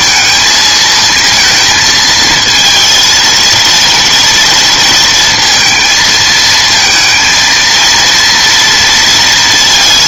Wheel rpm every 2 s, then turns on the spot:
220, 230, 230, 220, 230.
none